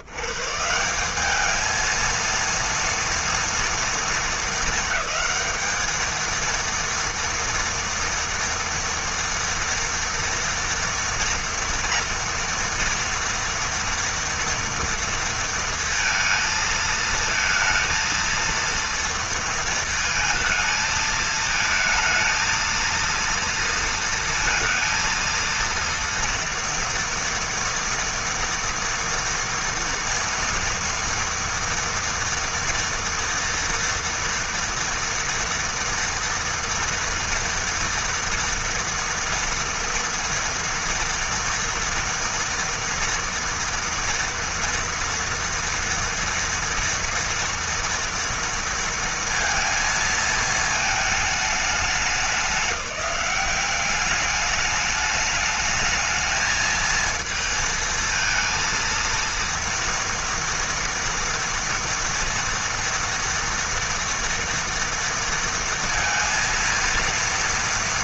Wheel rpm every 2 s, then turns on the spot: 110, 230, 230, 220, 230, 230, 230, 230, 230, 230, 220, 230, 230, 230, 230, 230, 230, 230, 230, 230, 230, 230, 230, 230, 230, 220, 190, 210, 220, 230, 240, 230, 230, 230.
none